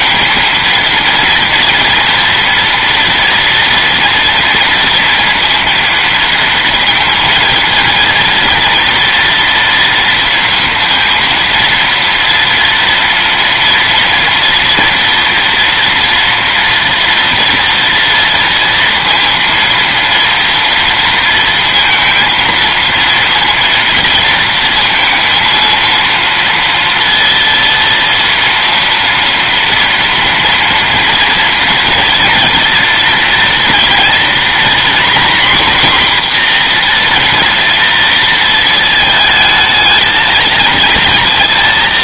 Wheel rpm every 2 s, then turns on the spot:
230, 230, 230, 230, 230, 230, 230, 230, 240, 230, 230, 230, 230, 230, 230, 230, 230, 240, 240, 230, 220.
none